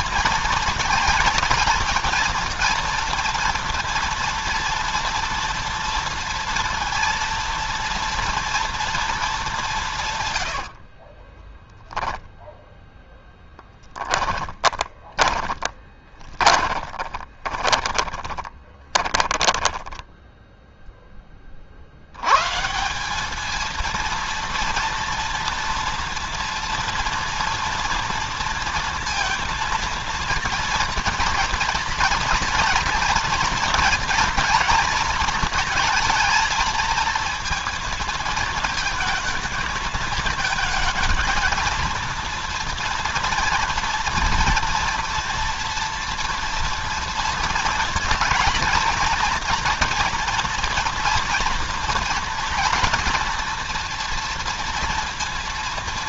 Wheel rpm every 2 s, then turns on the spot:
230, 230, 230, 230, 230, 80, 10, 10, 20, 20, 0, 140, 230, 230, 230, 230, 240, 230, 230, 230, 220, 230, 230, 230, 230, 230, 230, 230.
10-12 14-20